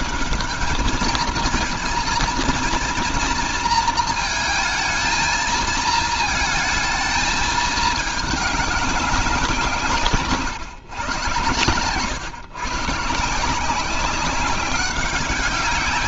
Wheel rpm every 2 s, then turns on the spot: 220, 230, 220, 230, 200, 130, 140, 190.
none